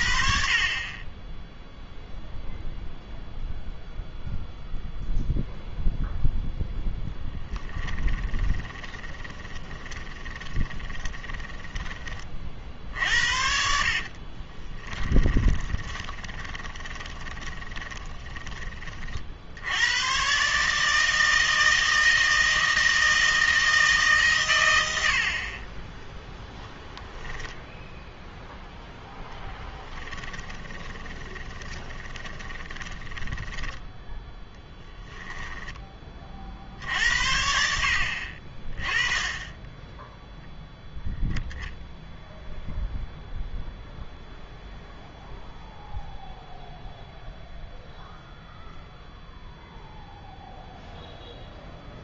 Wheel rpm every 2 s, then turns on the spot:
40, 0, 0, 0, 20, 20, 60, 20, 20, 30, 150, 160, 110, 0, 0, 20, 20, 10, 60, 30, 0, 0, 0, 0, 0, 0.
8-12 14-18 30-36